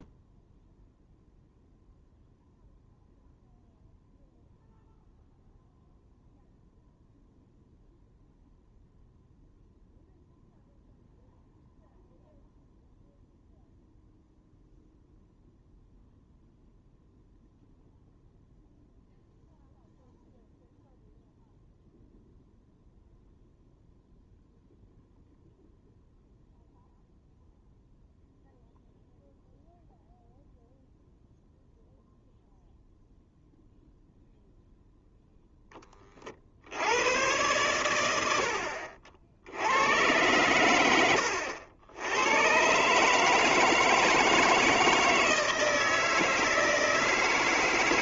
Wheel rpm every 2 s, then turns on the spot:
0, 0, 0, 0, 0, 0, 0, 0, 0, 0, 0, 0, 0, 0, 0, 0, 0, 0, 50, 70, 110, 110, 160, 160.
none